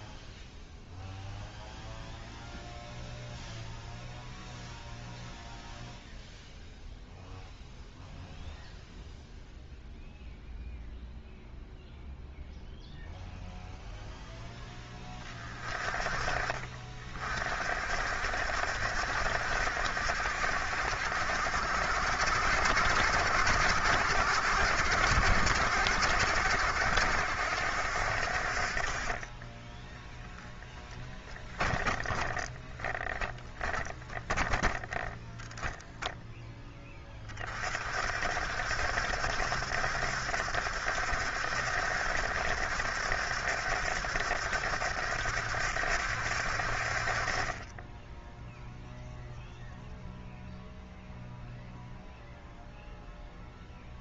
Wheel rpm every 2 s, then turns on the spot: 0, 0, 0, 0, 0, 0, 0, 10, 50, 70, 70, 70, 70, 60, 40, 20, 10, 0, 10, 70, 70, 70, 70, 50, 0, 0, 0.
none